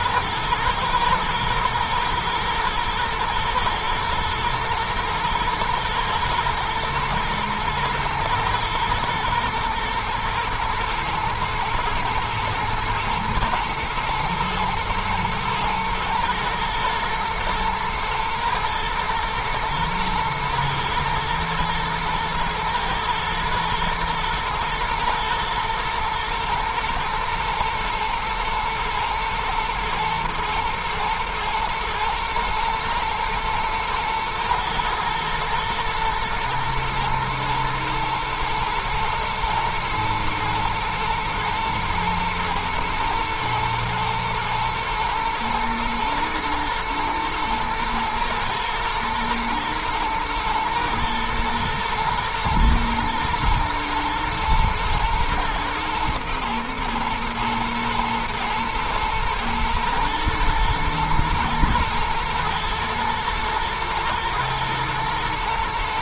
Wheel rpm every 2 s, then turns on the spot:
120, 120, 120, 110, 110, 120, 120, 110, 110, 120, 110, 120, 120, 110, 120, 110, 110, 110, 110, 120, 120, 120, 110, 110, 110, 110, 120, 110, 120, 120, 110, 110, 110.
none